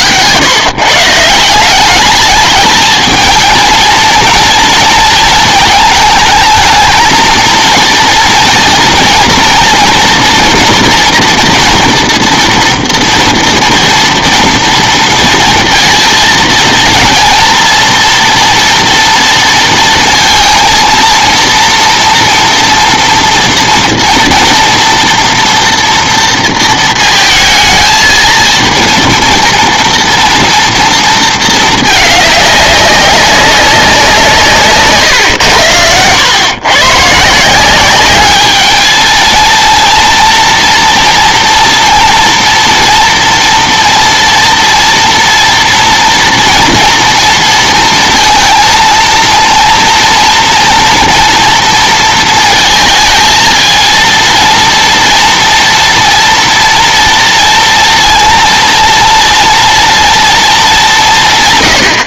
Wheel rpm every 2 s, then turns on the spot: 130, 210, 230, 220, 230, 240, 230, 230, 230, 240, 230, 230, 230, 230, 230, 230, 200, 150, 120, 210, 240, 230, 230, 240, 230, 230, 230, 230, 230, 230, 210.
none